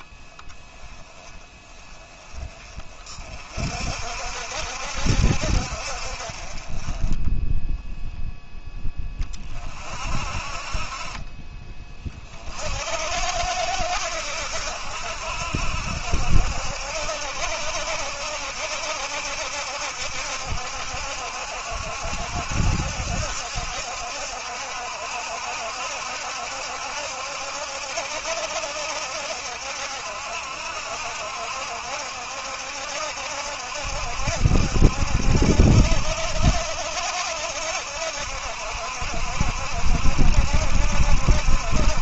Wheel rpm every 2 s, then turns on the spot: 10, 40, 60, 20, 20, 30, 60, 70, 70, 70, 70, 70, 70, 70, 70, 70, 70, 70, 70, 60, 70.
none